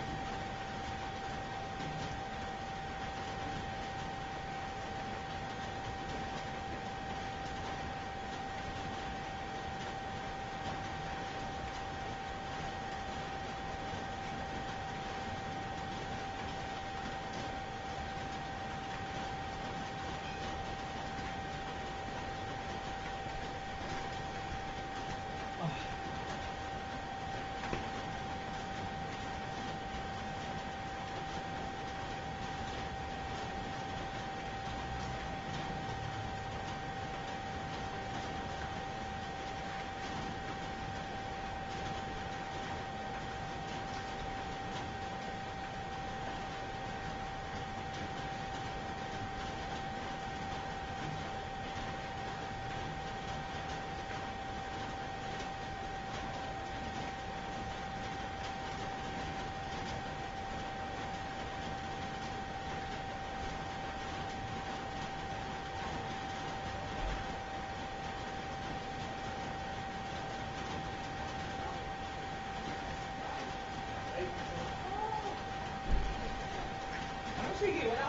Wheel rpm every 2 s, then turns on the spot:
0, 0, 0, 0, 0, 0, 0, 0, 0, 0, 0, 0, 0, 0, 0, 0, 0, 0, 0, 0, 0, 0, 0, 0, 0, 0, 0, 0, 0, 0, 0, 0, 0, 0, 0, 0, 0, 0, 0.
none